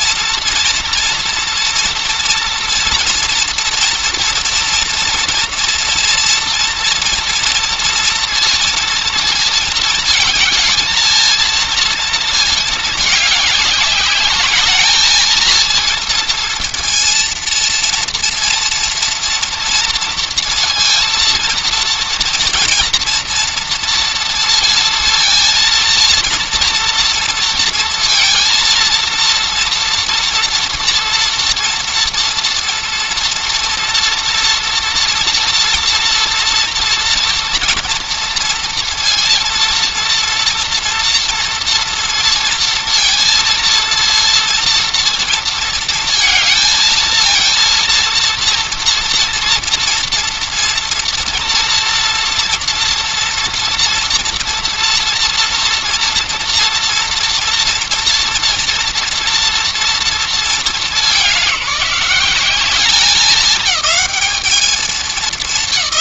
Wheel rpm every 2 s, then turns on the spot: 230, 230, 230, 230, 230, 220, 210, 220, 230, 230, 230, 230, 230, 230, 230, 230, 230, 230, 230, 230, 230, 230, 230, 220, 230, 230, 230, 240, 230, 230, 210, 200, 210.
none